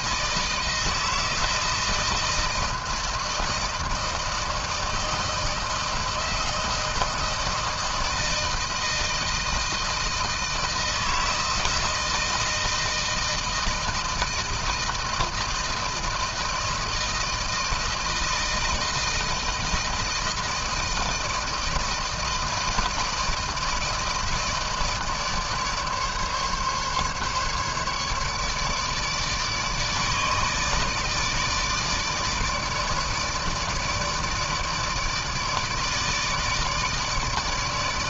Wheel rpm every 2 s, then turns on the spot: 160, 160, 160, 160, 160, 160, 160, 160, 160, 160, 160, 160, 160, 140, 150, 150, 160, 150, 160.
none